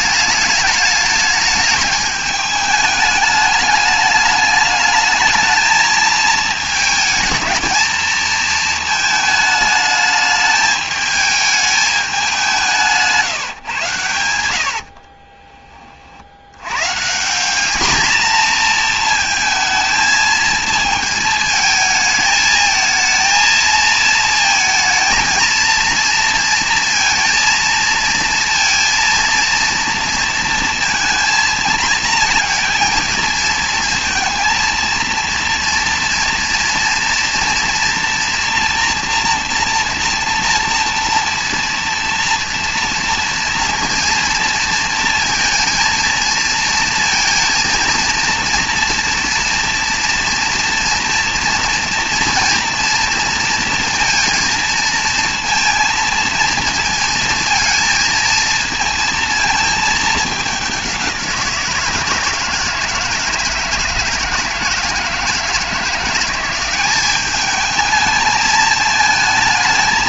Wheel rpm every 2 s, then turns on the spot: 210, 210, 210, 220, 230, 210, 200, 100, 80, 230, 220, 220, 220, 230, 230, 230, 230, 230, 230, 230, 240, 230, 230, 220, 230, 230, 230, 230, 230, 230, 210, 160, 160, 180, 220.
none